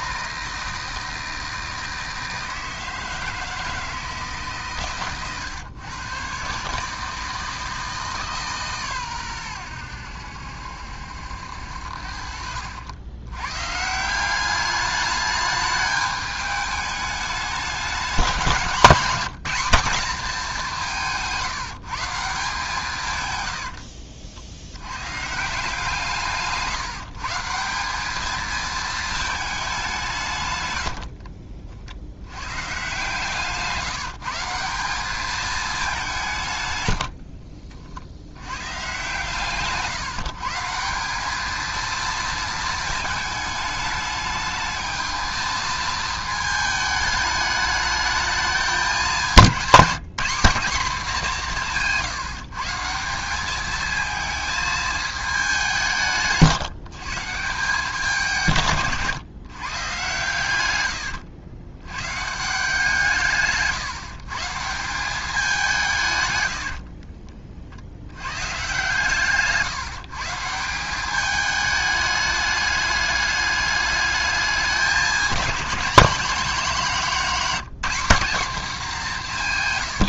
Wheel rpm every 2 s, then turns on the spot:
160, 160, 150, 140, 140, 70, 70, 200, 210, 190, 190, 160, 80, 160, 220, 100, 130, 180, 130, 120, 160, 220, 220, 220, 210, 210, 160, 220, 150, 150, 110, 160, 160, 70, 130, 170, 210, 200, 210, 220.
60-62 66-68